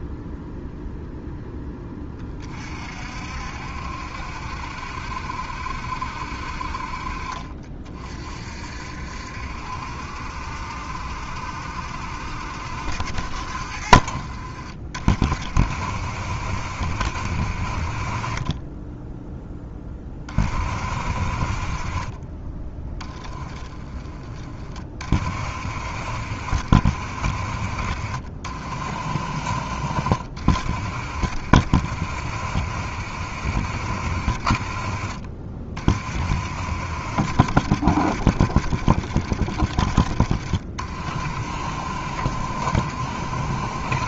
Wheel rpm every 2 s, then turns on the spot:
0, 50, 70, 50, 60, 70, 70, 50, 60, 10, 40, 20, 30, 60, 50, 50, 60, 40, 60, 50, 40, 50.
none